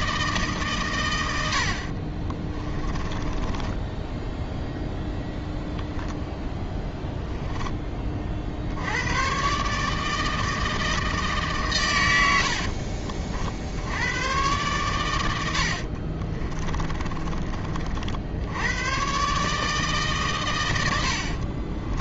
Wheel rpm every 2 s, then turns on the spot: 130, 30, 0, 10, 60, 160, 60, 110, 20, 100, 110.
2-4 12-14 16-18